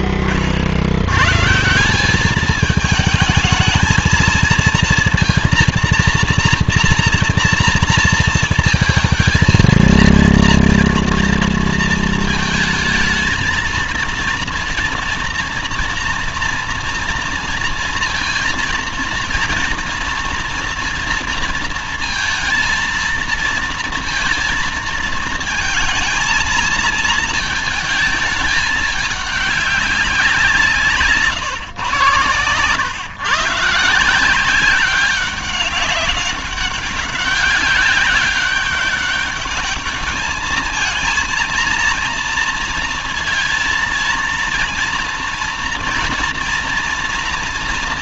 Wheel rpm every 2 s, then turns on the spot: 90, 220, 230, 230, 230, 230, 220, 230, 230, 230, 230, 230, 230, 230, 210, 150, 110, 190, 200, 200, 230, 230, 230, 240.
none